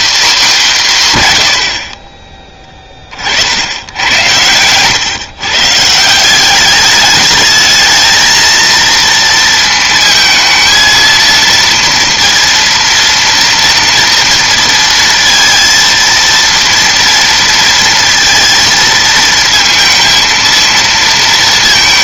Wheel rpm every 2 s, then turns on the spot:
210, 20, 110, 200, 230, 230, 230, 230, 230, 230, 230.
none